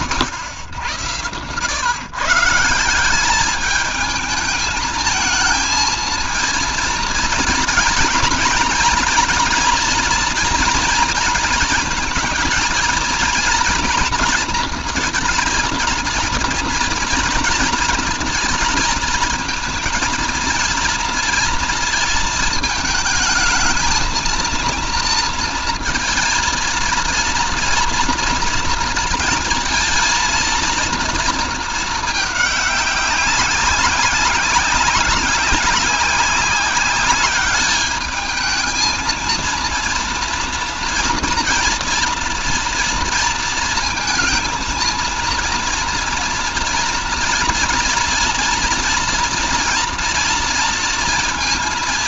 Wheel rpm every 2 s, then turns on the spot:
100, 190, 220, 230, 230, 230, 230, 230, 240, 220, 230, 220, 230, 230, 230, 230, 190, 190, 200, 220, 230, 230, 220, 230, 240, 230.
none